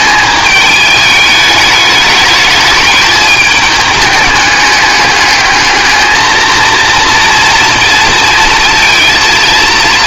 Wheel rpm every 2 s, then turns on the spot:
210, 210, 210, 230, 220.
none